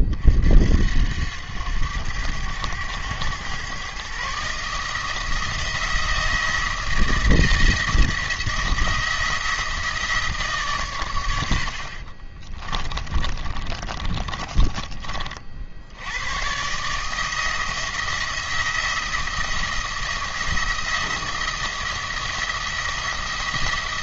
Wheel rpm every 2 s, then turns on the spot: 60, 100, 150, 170, 170, 140, 30, 30, 130, 170, 170, 170.
12-16